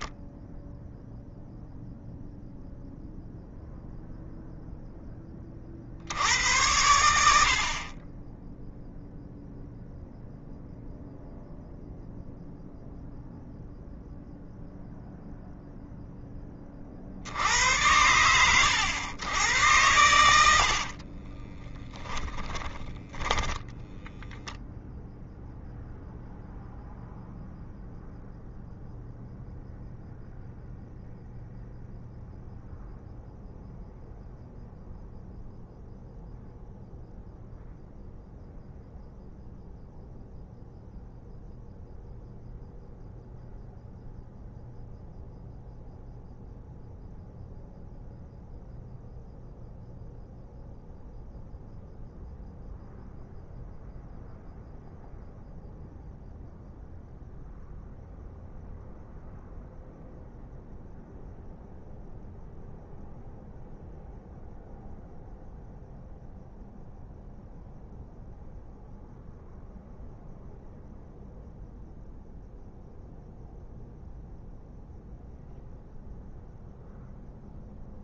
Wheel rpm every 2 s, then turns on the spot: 0, 0, 10, 70, 0, 0, 0, 0, 50, 100, 60, 10, 0, 0, 0, 0, 0, 0, 0, 0, 0, 0, 0, 0, 0, 0, 0, 0, 0, 0, 0, 0, 0, 0, 0, 0, 0, 0, 0.
20-24